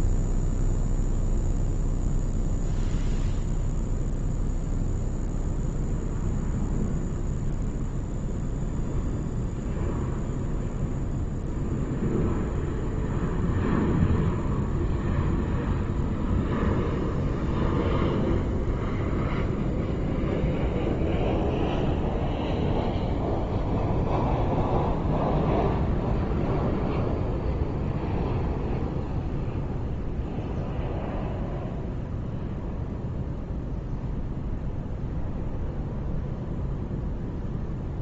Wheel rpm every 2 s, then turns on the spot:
0, 0, 0, 0, 0, 0, 0, 0, 0, 0, 0, 0, 0, 0, 0, 0, 0, 0, 0.
none